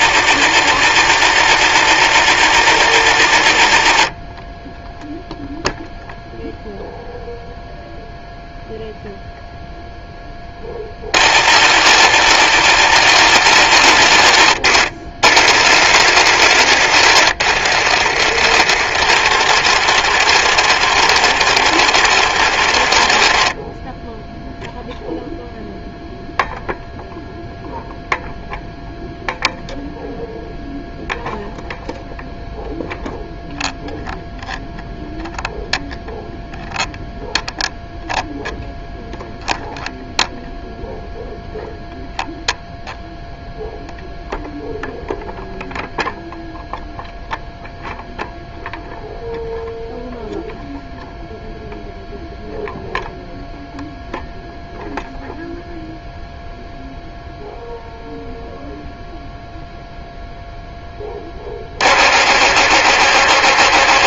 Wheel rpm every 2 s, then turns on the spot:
80, 90, 10, 0, 0, 30, 90, 60, 80, 60, 60, 40, 0, 0, 0, 0, 0, 0, 0, 0, 0, 0, 0, 0, 0, 0, 0, 0, 0, 0, 10, 60.
18-24